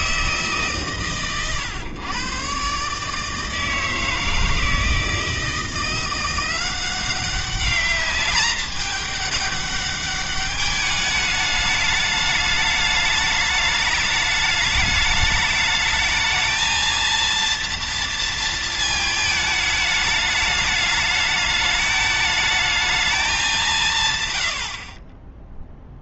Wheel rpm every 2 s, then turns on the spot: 140, 140, 160, 180, 210, 210, 210, 210, 230, 220, 210, 220, 70.
none